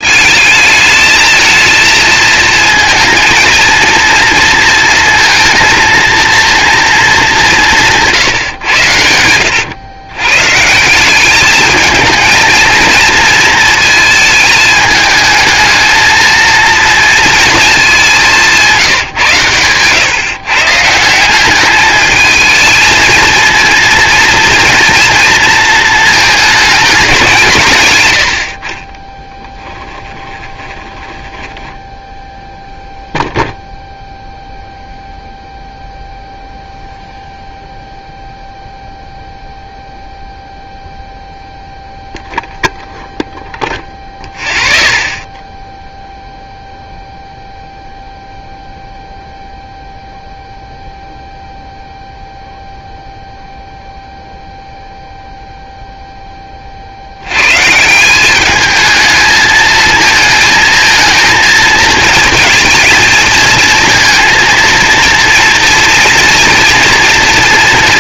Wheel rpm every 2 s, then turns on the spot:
210, 230, 230, 230, 100, 170, 230, 220, 230, 160, 160, 220, 230, 200, 30, 10, 0, 0, 0, 0, 0, 0, 0, 0, 0, 0, 0, 0, 50, 210, 220, 220, 230, 230.
18-20 30-32